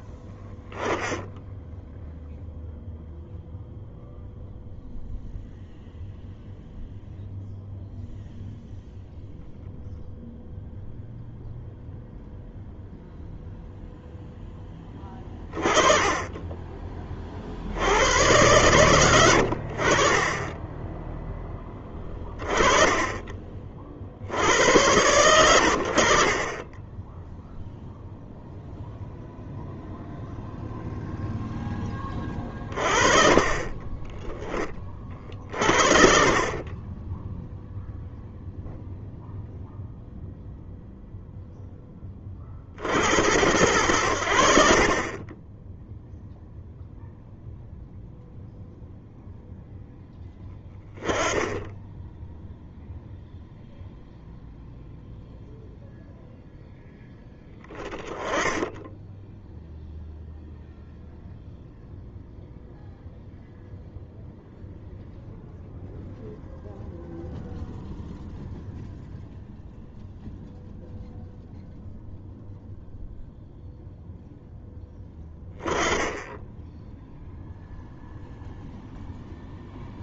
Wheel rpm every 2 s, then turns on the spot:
10, 0, 0, 0, 0, 0, 0, 10, 20, 100, 20, 20, 70, 30, 0, 0, 20, 20, 40, 0, 0, 40, 70, 0, 0, 10, 0, 0, 0, 10, 0, 0, 0, 0, 0, 0, 0, 0, 10, 0.
36-38 44-46